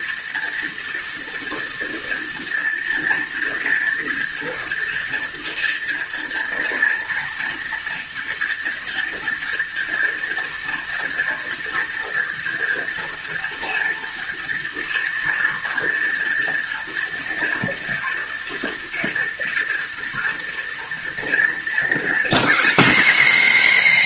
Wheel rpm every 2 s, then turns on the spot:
230, 230, 230, 230, 230, 230, 230, 230, 230, 230, 230, 240.
none